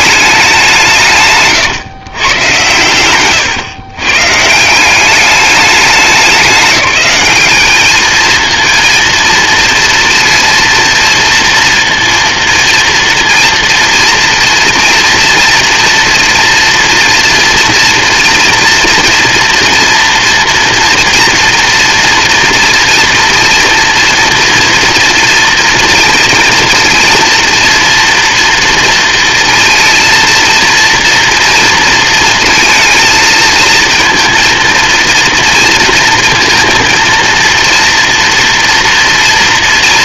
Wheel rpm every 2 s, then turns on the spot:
180, 100, 160, 180, 220, 230, 230, 240, 230, 230, 230, 230, 230, 230, 230, 230, 230, 230, 230, 230.
none